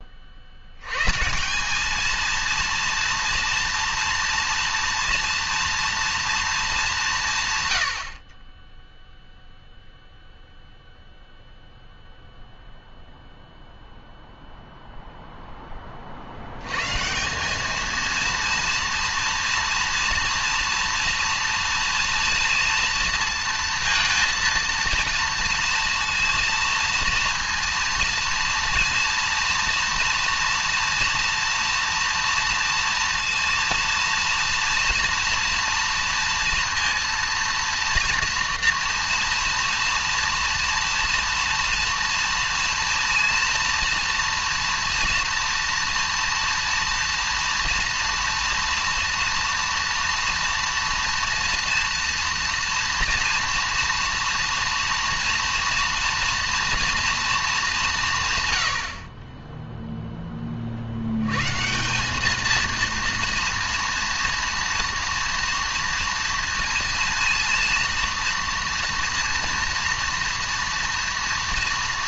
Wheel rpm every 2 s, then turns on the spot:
70, 230, 230, 220, 20, 0, 0, 0, 100, 230, 230, 230, 230, 230, 230, 230, 230, 230, 230, 240, 230, 230, 230, 230, 230, 230, 230, 230, 230, 110, 40, 230, 230, 230, 230, 230.
none